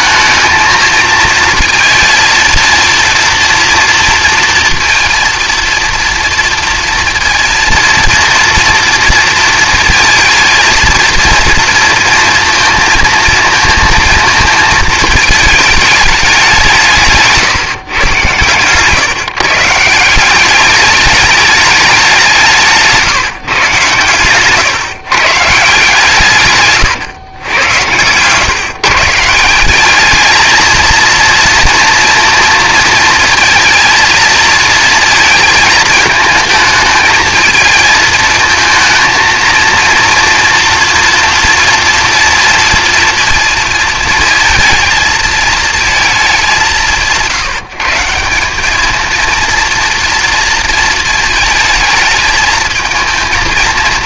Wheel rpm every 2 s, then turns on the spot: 220, 230, 230, 230, 230, 230, 230, 220, 160, 140, 200, 150, 140, 130, 150, 230, 230, 220, 220, 230, 230, 230, 220, 180, 210, 230, 220.
none